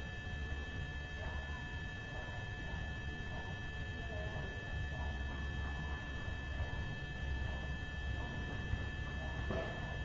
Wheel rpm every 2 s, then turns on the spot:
0, 0, 0, 0, 0.
none